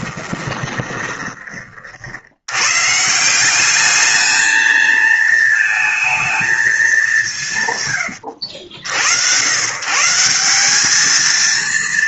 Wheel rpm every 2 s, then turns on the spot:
20, 90, 220, 230, 90, 160.
0-2